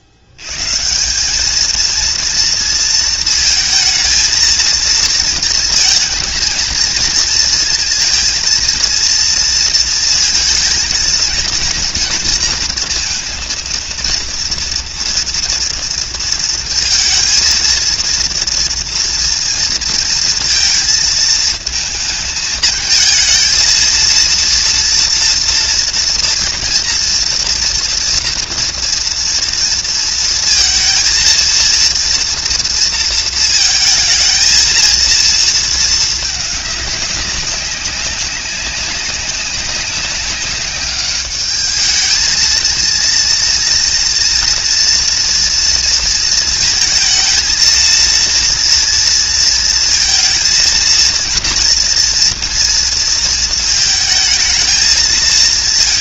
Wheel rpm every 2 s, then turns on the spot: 90, 230, 230, 220, 230, 220, 230, 230, 230, 230, 230, 220, 230, 230, 230, 230, 230, 230, 210, 190, 200, 220, 230, 230, 230, 230, 230, 220.
none